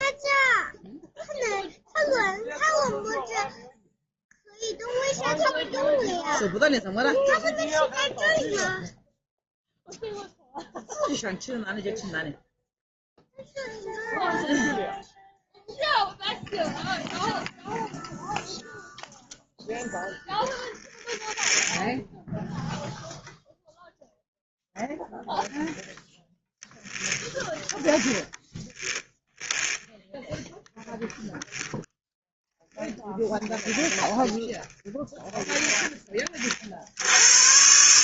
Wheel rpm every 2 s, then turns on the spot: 0, 0, 0, 0, 0, 0, 0, 0, 0, 0, 0, 0, 0, 0, 0, 0, 0, 0, 80.
36-38